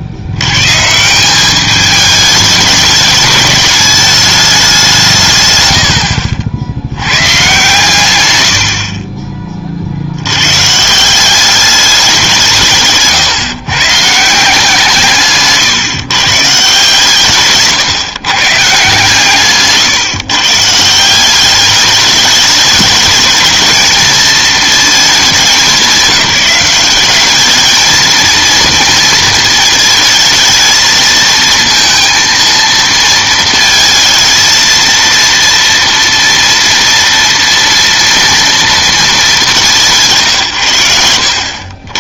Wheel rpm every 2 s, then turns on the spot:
120, 210, 200, 60, 80, 130, 160, 160, 150, 150, 160, 210, 220, 190, 230, 220, 230, 230, 230, 230, 120.
none